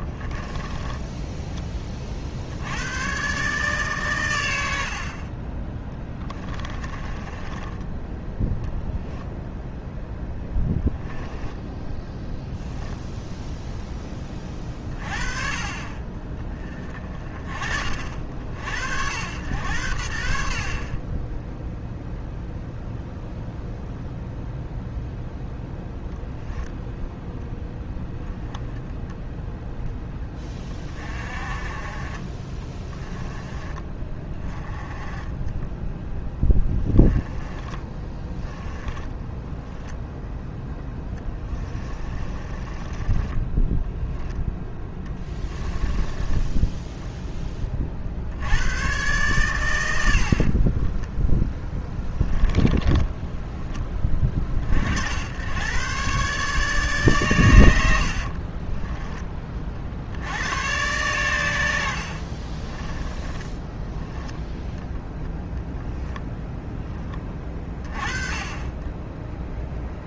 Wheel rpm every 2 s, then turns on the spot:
10, 100, 80, 30, 0, 10, 0, 40, 30, 80, 50, 0, 0, 0, 0, 40, 20, 20, 20, 20, 10, 20, 10, 10, 110, 20, 10, 60, 140, 30, 120, 20, 0, 10, 20.
0-2 6-8 10-12 32-34 36-40 42-48 50-54 58-60 62-64